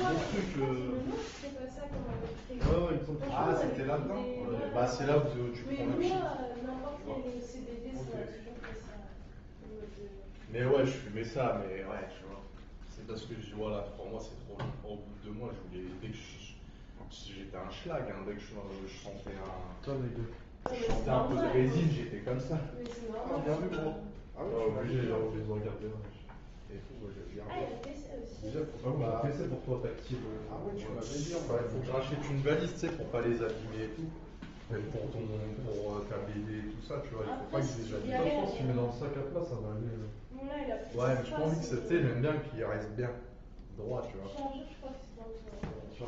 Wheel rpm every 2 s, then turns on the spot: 0, 0, 0, 0, 0, 0, 0, 0, 0, 0, 0, 0, 0, 0, 0, 0, 0, 0, 0, 0, 0, 0, 0.
none